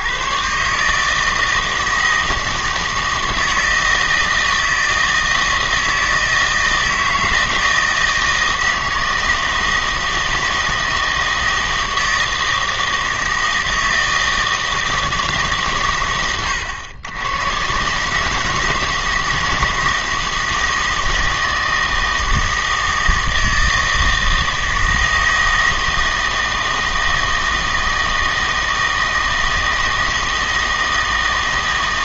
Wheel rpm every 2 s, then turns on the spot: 140, 160, 160, 160, 160, 160, 160, 160, 120, 150, 160, 160, 160, 160, 160, 160.
none